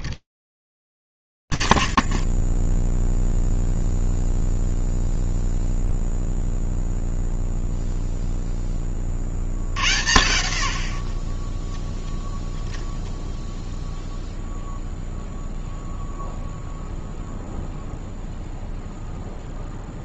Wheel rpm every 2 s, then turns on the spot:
0, 0, 0, 30, 50, 0, 10, 50, 0, 0.
none